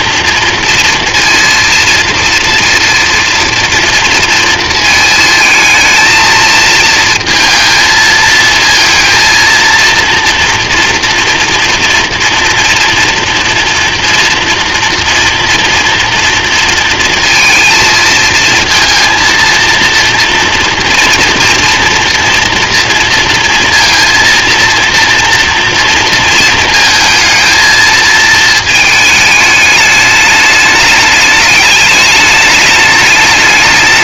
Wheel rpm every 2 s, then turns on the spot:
230, 230, 220, 230, 220, 240, 230, 240, 230, 230, 230, 230, 230, 230, 220, 210, 210.
none